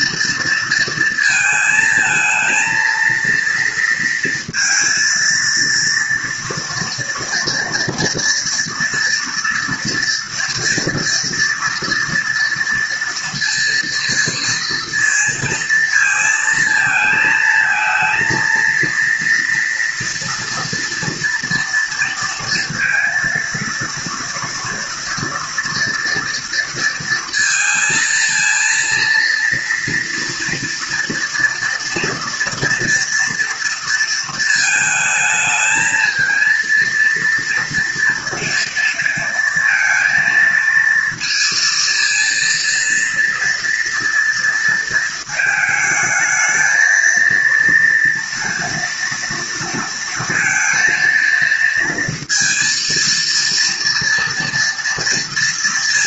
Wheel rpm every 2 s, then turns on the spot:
220, 230, 230, 230, 230, 230, 230, 230, 220, 230, 230, 230, 230, 230, 230, 230, 240, 220, 230, 230, 230, 230, 220, 230, 230, 230, 230, 230.
none